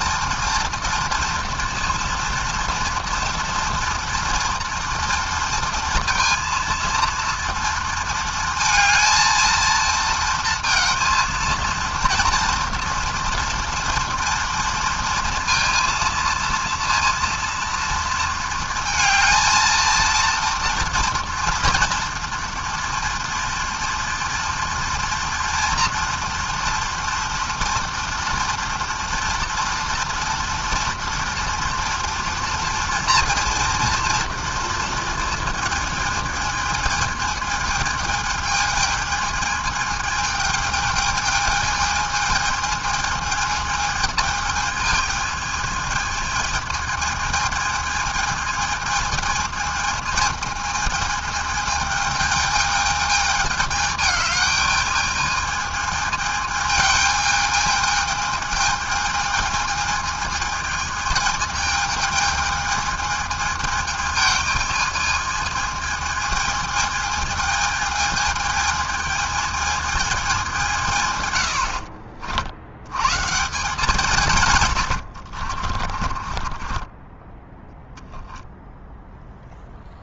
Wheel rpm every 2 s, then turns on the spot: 230, 230, 230, 230, 230, 230, 240, 230, 230, 230, 240, 230, 230, 230, 240, 240, 230, 230, 220, 220, 220, 220, 220, 220, 220, 220, 220, 220, 220, 220, 220, 220, 220, 220, 220, 110, 150, 50, 10, 0.
74-76